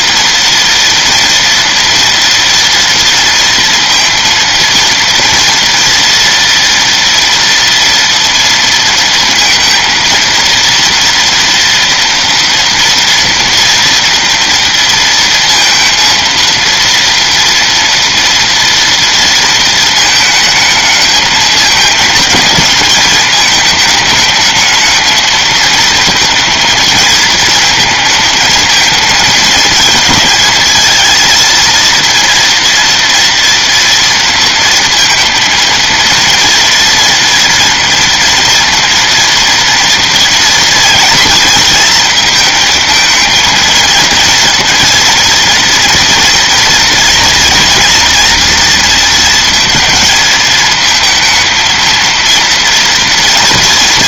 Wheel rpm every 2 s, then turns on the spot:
230, 230, 230, 230, 230, 230, 230, 230, 230, 220, 220, 210, 230, 220, 220, 230, 230, 230, 230, 230, 230, 230, 230, 230, 220, 230, 230.
none